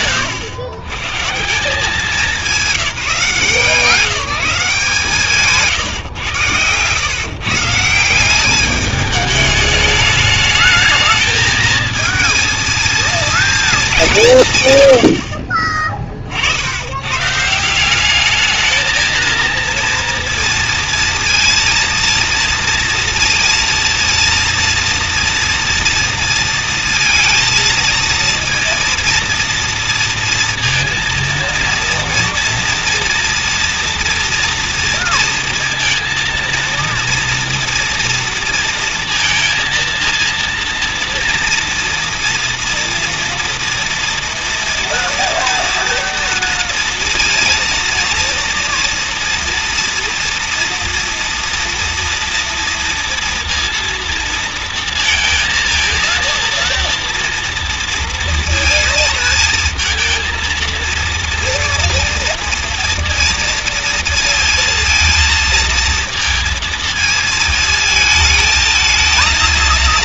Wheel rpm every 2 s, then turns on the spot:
130, 180, 150, 110, 210, 220, 230, 110, 90, 220, 230, 230, 230, 230, 230, 230, 230, 230, 230, 230, 230, 230, 230, 230, 230, 240, 230, 220, 230, 230, 230, 230, 230, 230, 220.
none